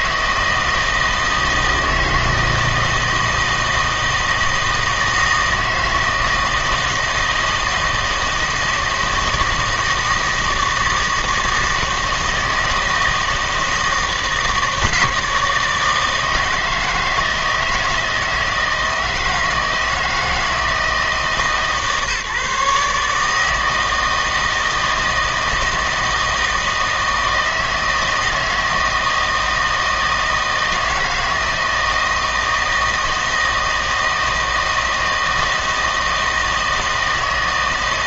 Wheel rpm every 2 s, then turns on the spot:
160, 160, 160, 160, 160, 160, 160, 160, 160, 160, 160, 150, 160, 160, 160, 160, 160, 160, 160.
none